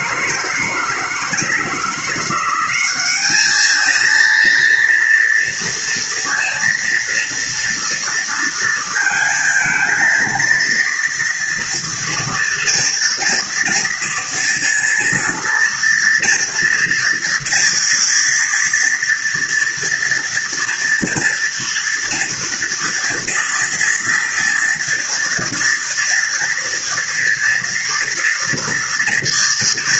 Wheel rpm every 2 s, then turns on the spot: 160, 190, 230, 230, 230, 230, 230, 230, 230, 230, 230, 230, 230, 230, 230.
none